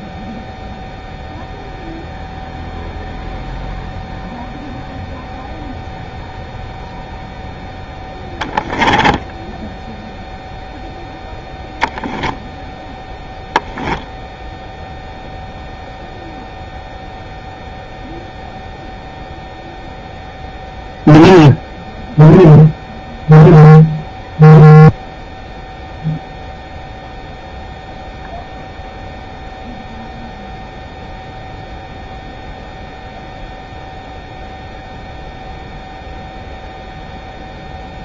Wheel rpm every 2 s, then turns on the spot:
0, 0, 0, 0, 10, 0, 0, 0, 0, 0, 0, 0, 0, 0, 0, 0, 0, 0, 0.
8-10